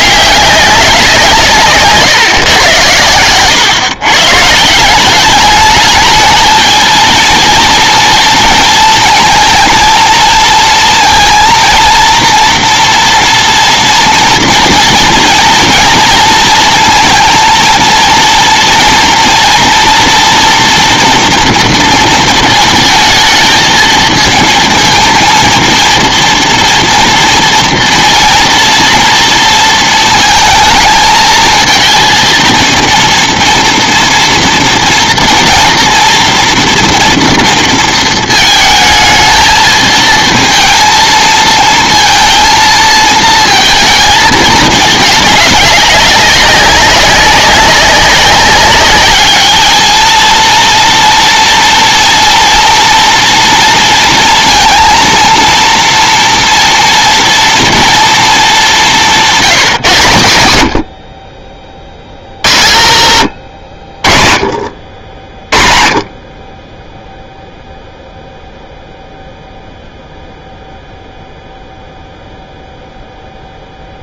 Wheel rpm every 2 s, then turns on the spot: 200, 130, 150, 220, 230, 230, 240, 230, 230, 230, 240, 220, 220, 230, 230, 220, 230, 230, 240, 220, 220, 230, 210, 200, 200, 230, 240, 230, 230, 200, 70, 80, 30, 10, 0, 0, 0.
none